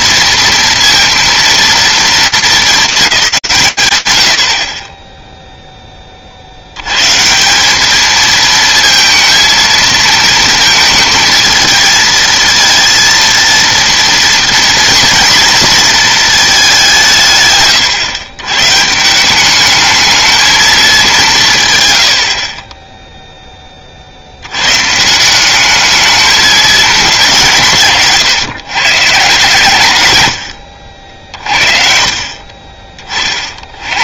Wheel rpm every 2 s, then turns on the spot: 230, 220, 40, 90, 220, 220, 230, 230, 200, 120, 220, 30, 140, 210, 140, 50, 40.
none